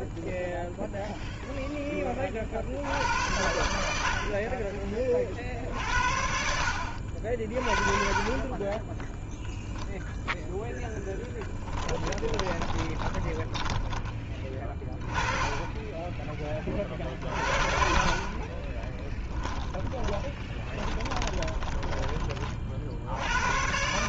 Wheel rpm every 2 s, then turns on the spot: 0, 50, 30, 60, 20, 10, 20, 20, 20, 30, 30, 40.
12-16 18-22